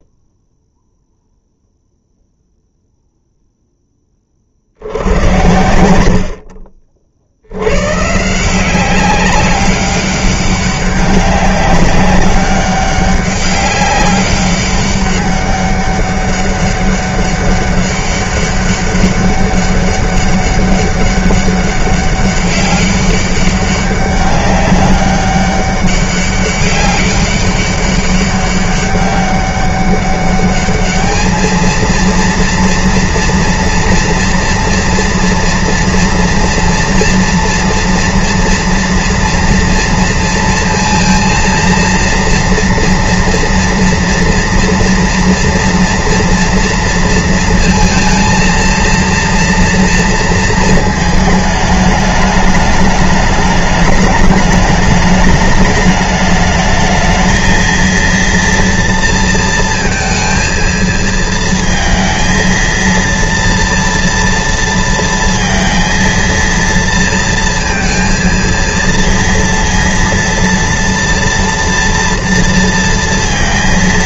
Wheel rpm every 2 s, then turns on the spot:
0, 0, 60, 60, 180, 200, 200, 200, 200, 200, 200, 200, 200, 200, 200, 210, 230, 240, 230, 230, 220, 230, 230, 230, 230, 230, 210, 210, 220, 230, 230, 230, 230, 230, 230, 230, 230.
none